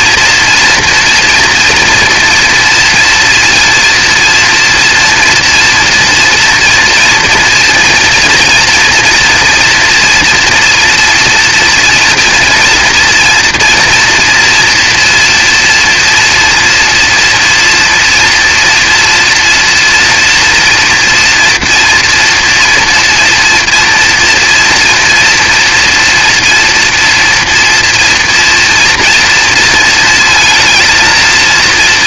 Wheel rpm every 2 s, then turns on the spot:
240, 230, 230, 230, 230, 230, 230, 230, 230, 230, 230, 240, 230, 230, 230, 230.
none